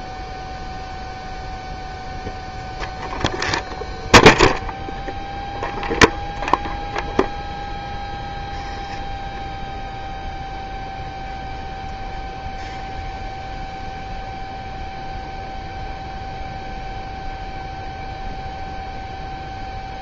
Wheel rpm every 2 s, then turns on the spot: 0, 0, 0, 0, 0, 0, 0, 0, 0, 0.
none